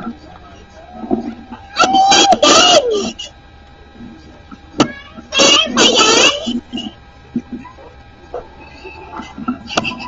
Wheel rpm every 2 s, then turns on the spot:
0, 0, 0, 0, 0.
none